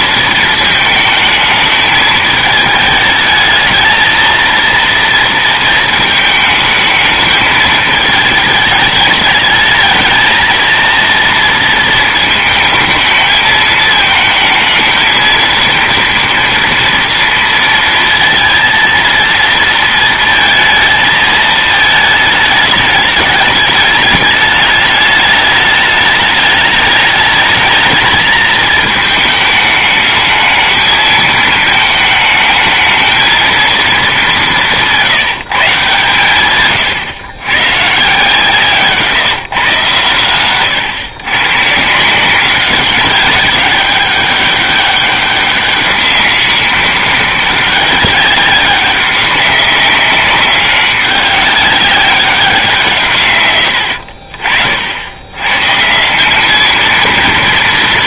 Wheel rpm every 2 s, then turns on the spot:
220, 220, 230, 220, 210, 220, 220, 220, 230, 230, 220, 220, 210, 210, 220, 220, 220, 190, 120, 160, 120, 190, 200, 200, 200, 190, 170, 70, 220.
none